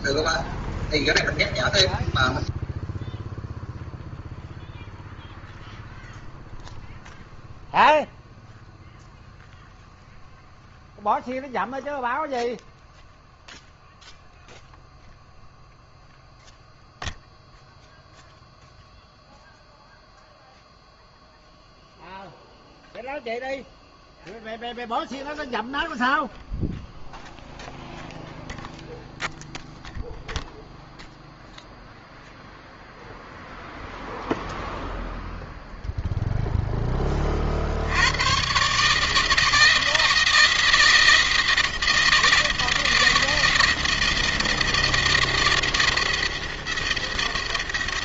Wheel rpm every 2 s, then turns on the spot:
0, 0, 0, 0, 0, 0, 0, 0, 0, 0, 0, 0, 0, 0, 0, 0, 0, 0, 10, 140, 160, 170, 170, 170.
none